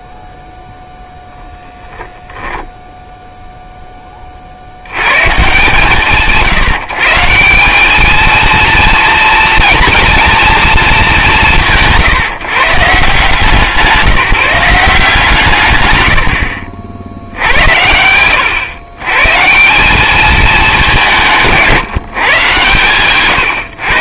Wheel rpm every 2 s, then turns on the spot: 0, 0, 30, 140, 230, 230, 140, 160, 70, 110, 190, 130.
none